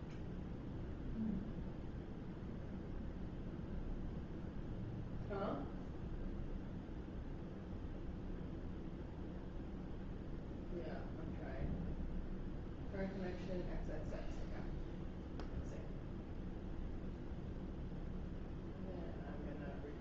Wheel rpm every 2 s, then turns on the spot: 0, 0, 0, 0, 0, 0, 0, 0, 0, 0.
none